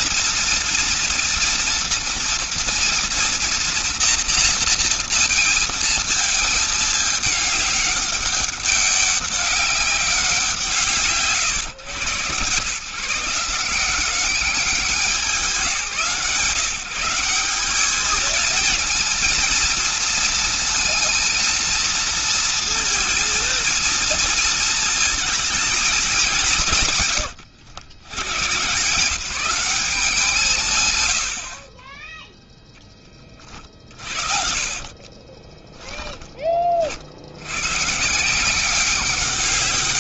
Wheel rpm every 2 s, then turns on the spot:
230, 230, 240, 220, 200, 180, 140, 180, 160, 220, 230, 230, 230, 200, 120, 180, 10, 40, 30, 160.
34-36